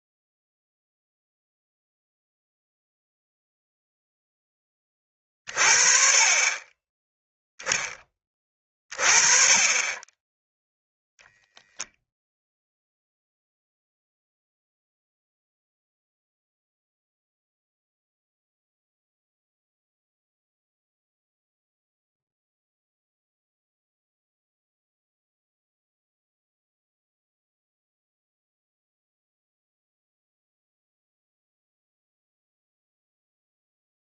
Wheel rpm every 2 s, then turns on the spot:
0, 0, 10, 20, 20, 0, 0, 0, 0, 0, 0, 0, 0, 0, 0, 0, 0.
none